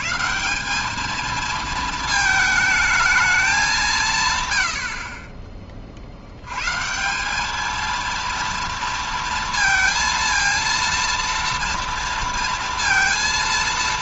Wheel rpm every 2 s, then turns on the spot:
180, 220, 110, 120, 230, 230, 230.
none